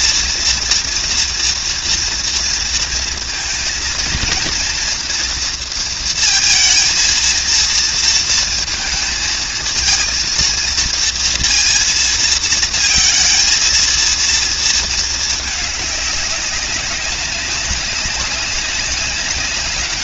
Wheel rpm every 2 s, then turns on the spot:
230, 230, 240, 230, 230, 230, 220, 220, 200, 190.
none